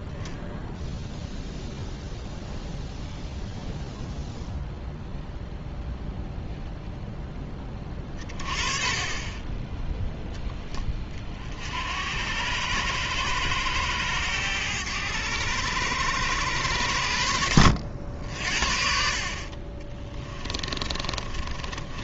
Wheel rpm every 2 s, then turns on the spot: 0, 0, 0, 0, 30, 10, 90, 100, 100, 60, 20.
20-22